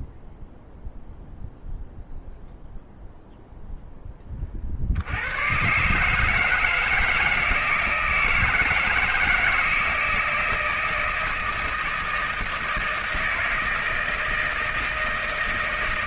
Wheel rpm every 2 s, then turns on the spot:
0, 0, 90, 160, 160, 160, 170, 160.
none